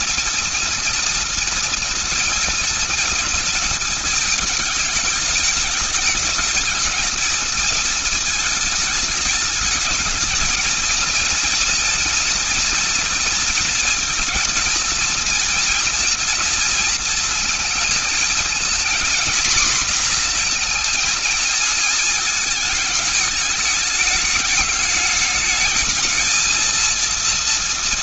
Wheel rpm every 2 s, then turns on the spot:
230, 230, 220, 210, 220, 210, 230, 230, 230, 230, 240, 220, 210, 220.
none